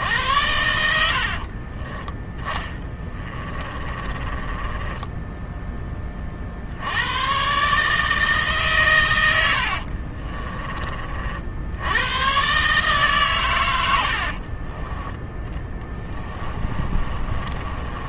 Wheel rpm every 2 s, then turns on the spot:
70, 20, 10, 80, 120, 30, 140, 20, 30.
2-6 14-18